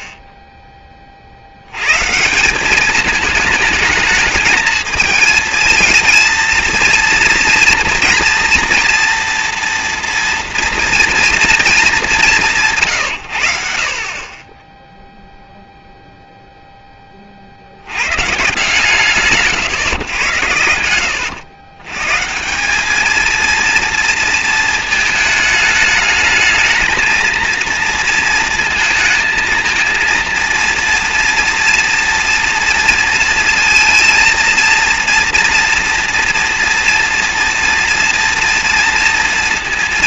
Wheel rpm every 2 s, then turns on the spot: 20, 200, 220, 230, 230, 230, 160, 10, 30, 140, 100, 220, 220, 230, 230, 230, 230, 230, 230, 230.
none